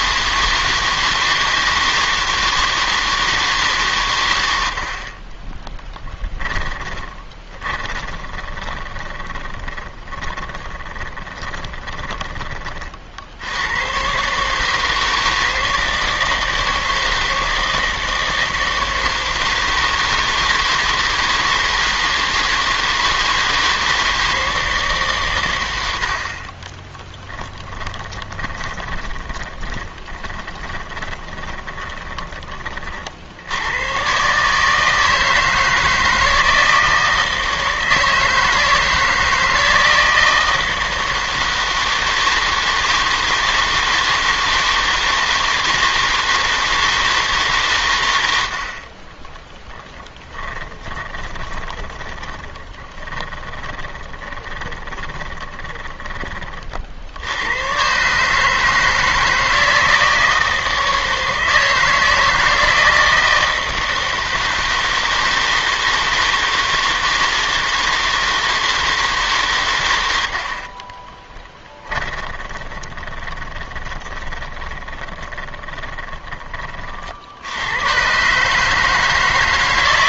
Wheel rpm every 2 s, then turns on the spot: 160, 160, 60, 20, 20, 20, 40, 160, 160, 160, 160, 160, 150, 10, 20, 20, 40, 160, 160, 160, 160, 160, 160, 160, 40, 20, 20, 20, 40, 160, 160, 160, 160, 160, 160, 30, 20, 20, 50, 160.
6-12 26-32 50-56 70-76